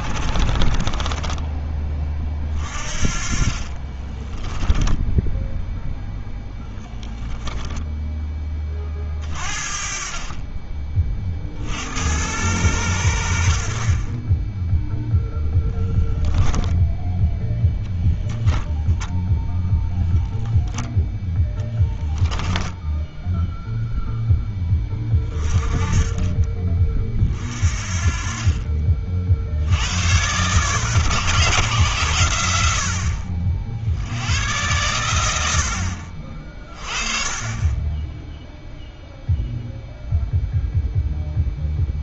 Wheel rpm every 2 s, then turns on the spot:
30, 30, 10, 10, 30, 30, 90, 0, 10, 0, 0, 10, 10, 30, 40, 130, 80, 100, 30, 0, 0.
0-2 4-8 22-24